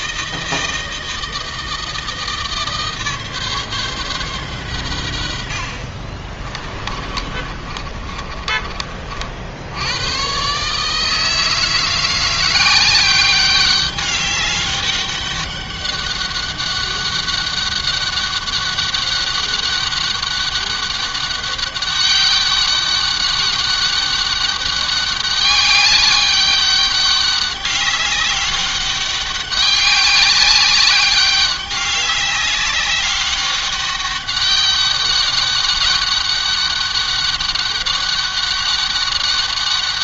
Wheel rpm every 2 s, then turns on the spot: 160, 150, 110, 30, 40, 140, 180, 200, 200, 200, 200, 200, 200, 200, 200, 200, 200, 200, 200, 200.
6-8